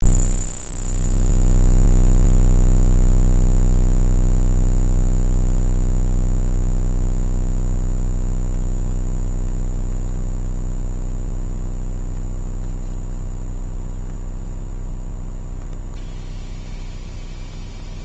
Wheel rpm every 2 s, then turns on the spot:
0, 0, 0, 0, 0, 0, 0, 0, 0.
none